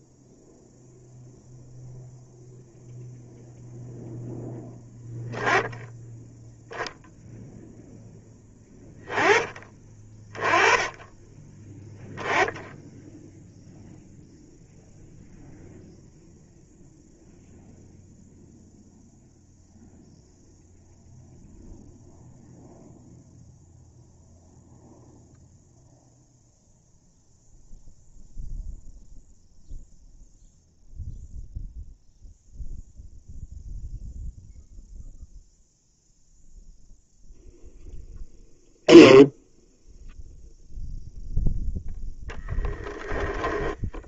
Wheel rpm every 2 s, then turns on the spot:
0, 0, 10, 0, 10, 10, 0, 0, 0, 0, 0, 0, 0, 0, 0, 0, 0, 0, 0, 0, 0, 10.
42-44